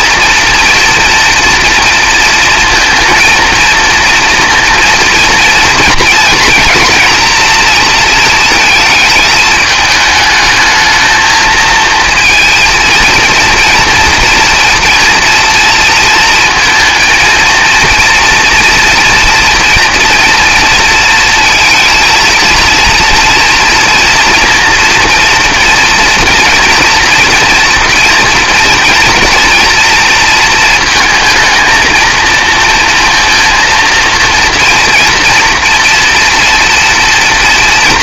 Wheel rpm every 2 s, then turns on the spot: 230, 230, 230, 230, 230, 220, 230, 230, 230, 230, 230, 230, 240, 240, 240, 230, 230, 230, 240.
none